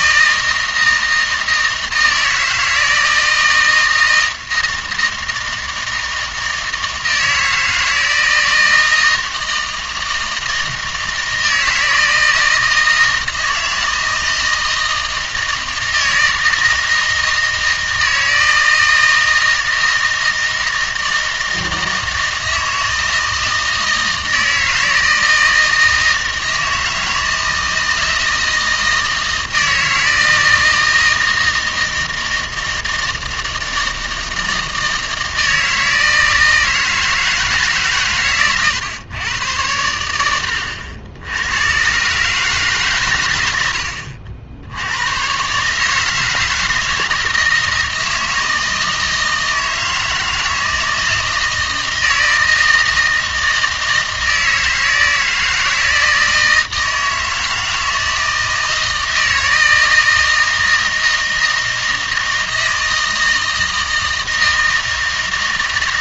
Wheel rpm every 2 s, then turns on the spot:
160, 160, 160, 160, 160, 160, 160, 160, 160, 160, 160, 160, 160, 160, 160, 160, 160, 160, 160, 120, 80, 140, 90, 160, 160, 160, 160, 160, 160, 160, 160, 160, 160.
none